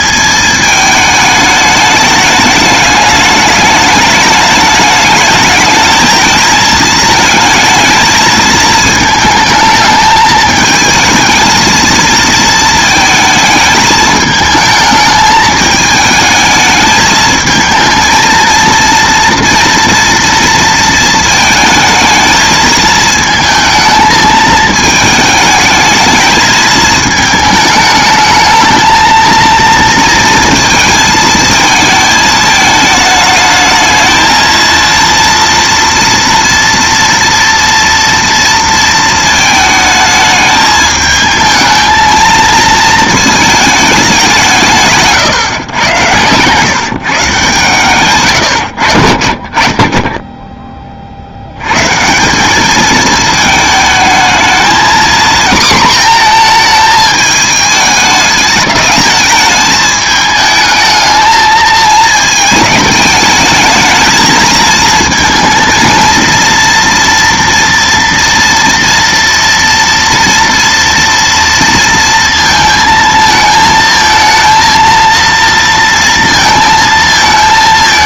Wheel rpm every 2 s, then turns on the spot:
210, 210, 220, 220, 220, 220, 220, 220, 220, 230, 230, 220, 220, 220, 220, 230, 220, 230, 230, 230, 220, 220, 160, 140, 90, 20, 210, 230, 220, 210, 220, 210, 220, 230, 230, 230, 230, 230, 230.
none